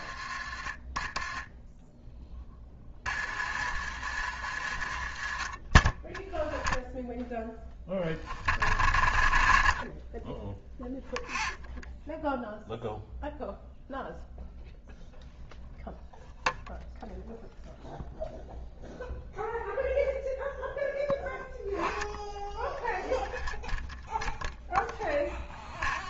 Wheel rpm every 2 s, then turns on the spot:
30, 30, 50, 0, 30, 0, 0, 0, 0, 0, 0, 0, 0.
none